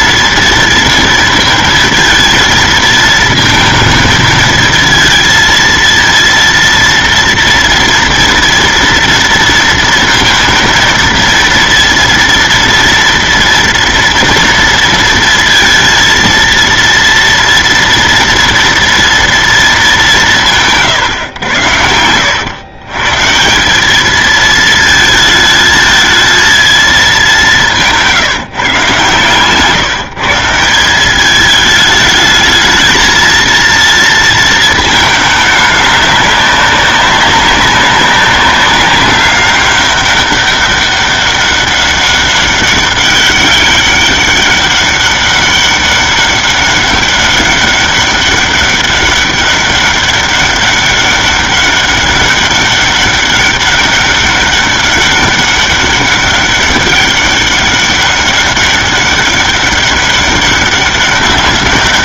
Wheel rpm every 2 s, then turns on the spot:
230, 230, 220, 230, 230, 230, 230, 230, 230, 230, 170, 110, 220, 220, 150, 170, 220, 230, 200, 200, 200, 190, 200, 200, 200, 200, 200, 200, 200, 200, 200.
none